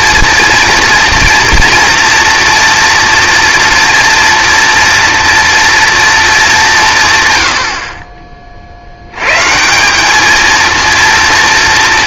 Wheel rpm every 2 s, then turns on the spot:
230, 230, 230, 200, 50, 230.
none